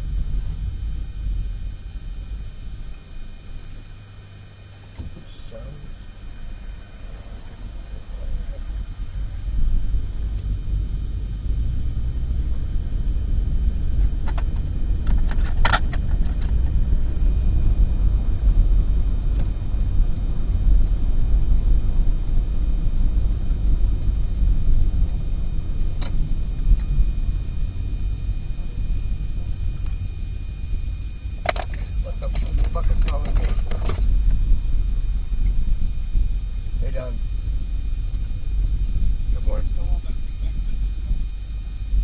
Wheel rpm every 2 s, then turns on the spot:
0, 0, 0, 0, 0, 0, 0, 0, 0, 0, 0, 0, 0, 0, 0, 0, 0, 0, 0, 0, 0.
none